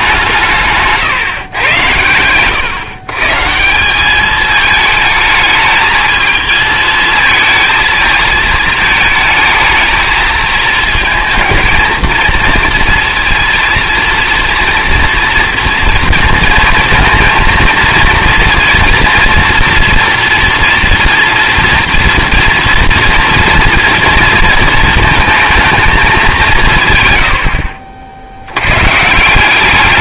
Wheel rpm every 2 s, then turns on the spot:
140, 130, 220, 220, 220, 220, 230, 230, 230, 230, 230, 230, 220, 150, 110.
none